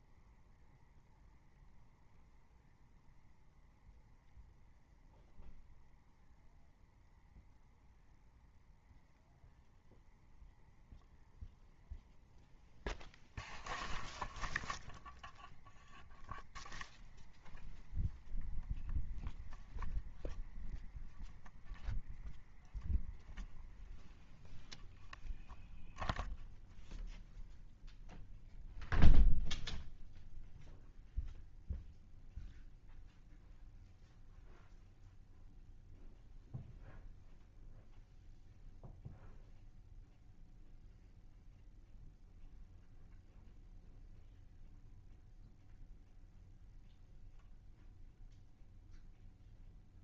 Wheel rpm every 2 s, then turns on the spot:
0, 0, 0, 0, 0, 0, 0, 0, 0, 0, 0, 0, 0, 0, 0, 0, 0, 0, 0, 0, 0, 0, 0, 0, 0.
none